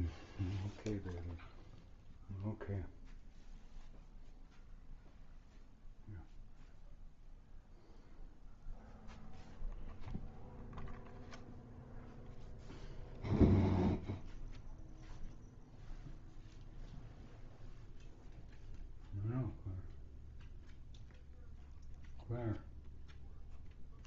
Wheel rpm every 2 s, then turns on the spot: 0, 0, 0, 0, 0, 0, 0, 0, 0, 0, 0, 0.
none